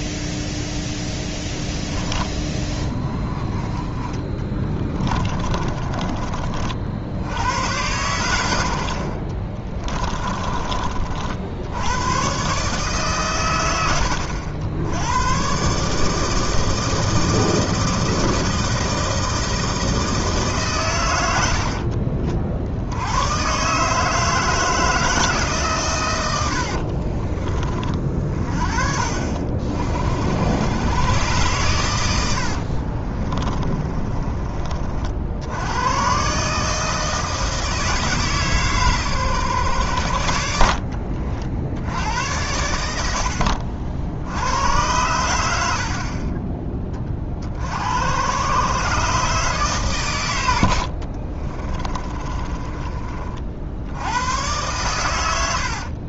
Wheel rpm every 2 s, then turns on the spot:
0, 30, 20, 50, 70, 40, 130, 80, 160, 160, 130, 70, 160, 60, 40, 100, 50, 40, 150, 130, 70, 80, 90, 20, 130, 70, 30, 110.
4-6 26-28 32-34 40-42 50-54